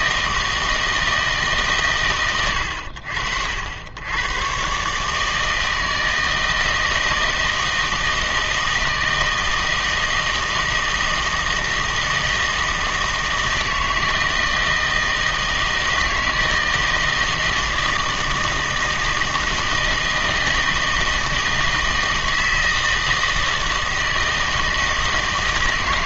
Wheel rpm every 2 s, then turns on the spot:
160, 90, 130, 160, 160, 160, 160, 160, 160, 160, 160, 160, 160.
none